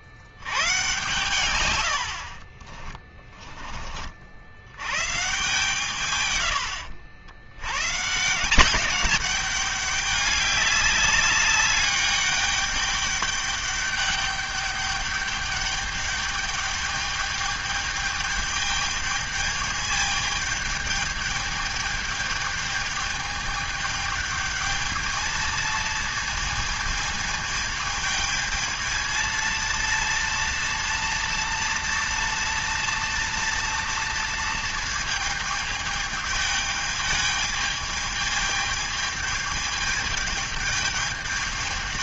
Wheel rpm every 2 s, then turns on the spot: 100, 50, 60, 120, 170, 200, 200, 200, 210, 210, 210, 210, 210, 230, 220, 230, 230, 230, 210, 210, 210.
2-4